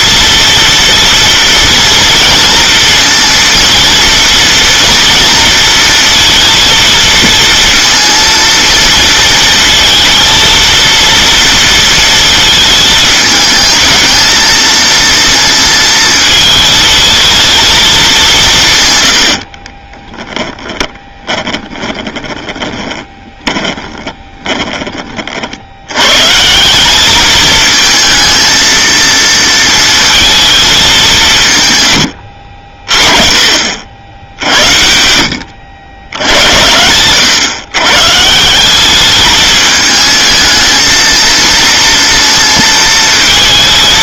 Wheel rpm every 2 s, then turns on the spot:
230, 230, 230, 230, 230, 230, 220, 230, 220, 170, 10, 30, 20, 150, 220, 220, 70, 70, 90, 170, 220, 230.
22-26